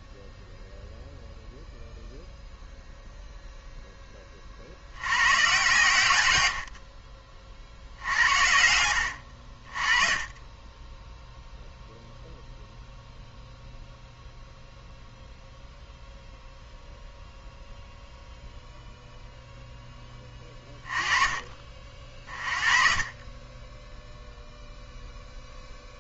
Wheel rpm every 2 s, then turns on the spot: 0, 0, 90, 50, 70, 10, 0, 0, 0, 0, 30, 40, 0.
none